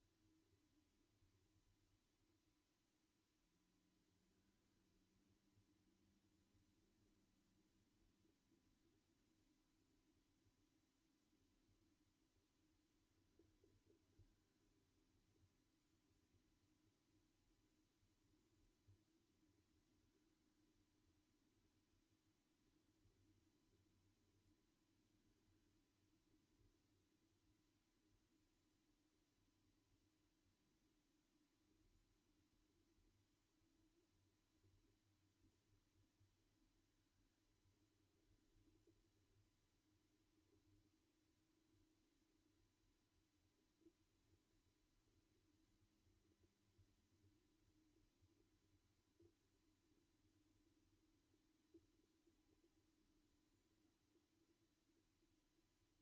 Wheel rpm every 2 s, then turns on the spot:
0, 0, 0, 0, 0, 0, 0, 0, 0, 0, 0, 0, 0, 0, 0, 0, 0, 0, 0, 0, 0, 0, 0, 0, 0, 0, 0, 0.
none